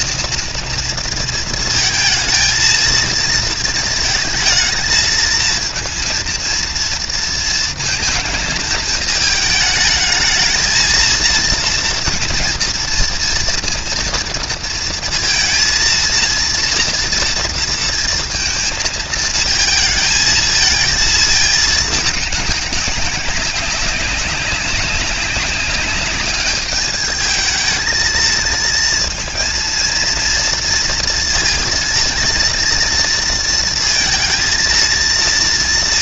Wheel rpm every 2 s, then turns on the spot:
230, 220, 220, 230, 220, 220, 230, 230, 230, 230, 220, 200, 190, 210, 230, 230, 230, 230.
none